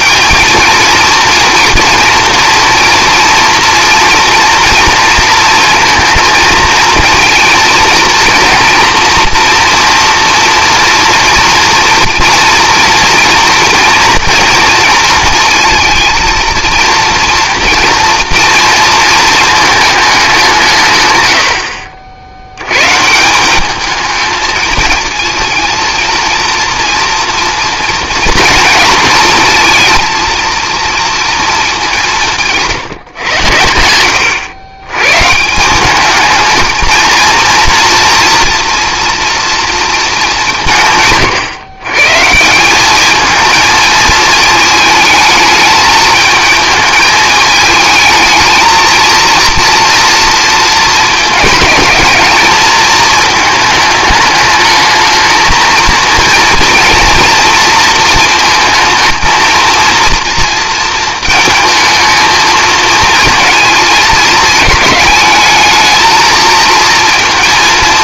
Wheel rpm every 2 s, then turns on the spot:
230, 230, 230, 230, 230, 230, 240, 230, 230, 230, 140, 120, 220, 230, 230, 230, 160, 110, 230, 240, 160, 190, 220, 220, 220, 220, 220, 210, 230, 220, 230, 220, 210, 230.
none